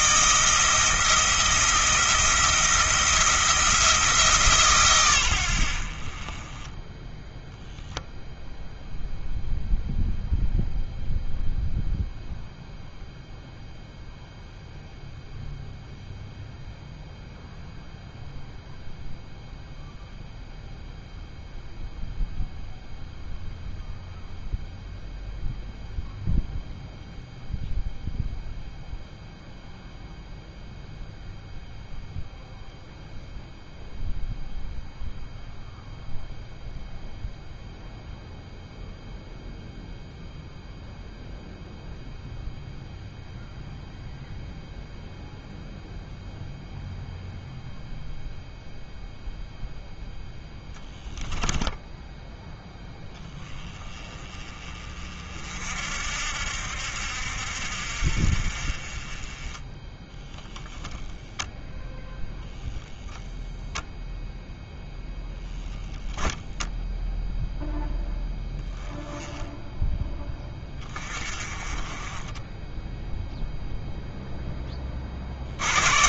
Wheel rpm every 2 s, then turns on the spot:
160, 170, 140, 20, 0, 0, 0, 0, 0, 0, 0, 0, 0, 0, 0, 0, 0, 0, 0, 0, 0, 0, 0, 0, 0, 10, 10, 30, 70, 40, 0, 0, 0, 0, 10, 20, 10, 20.
none